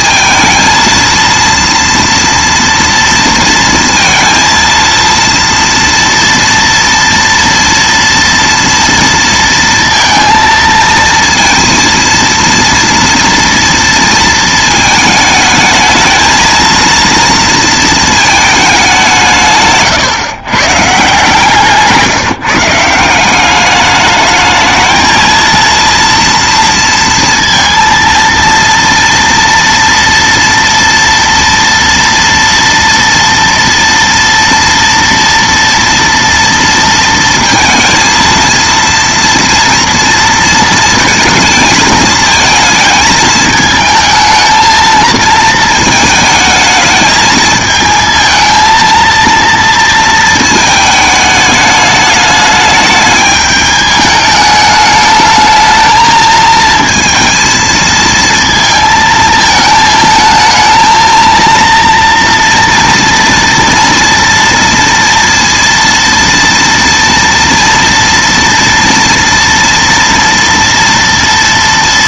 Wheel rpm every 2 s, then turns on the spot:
220, 230, 230, 230, 230, 230, 230, 220, 230, 210, 140, 170, 220, 230, 230, 230, 230, 230, 230, 230, 230, 220, 220, 220, 230, 220, 210, 210, 230, 230, 220, 230, 230, 230, 230, 230.
none